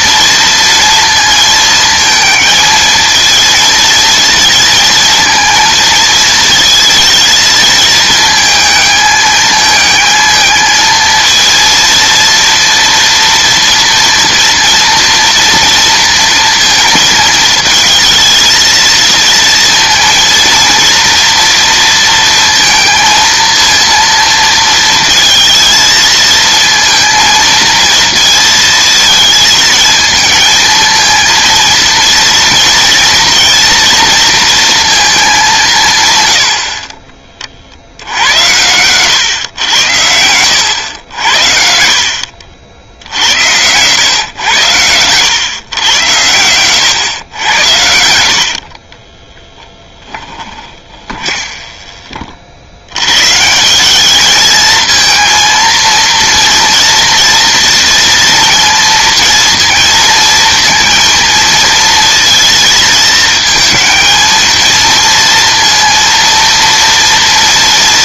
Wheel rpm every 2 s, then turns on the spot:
230, 220, 230, 220, 220, 220, 230, 230, 230, 220, 230, 230, 230, 230, 230, 220, 230, 230, 110, 90, 100, 80, 110, 110, 40, 20, 80, 220, 230, 230, 230, 230, 230, 230.
48-52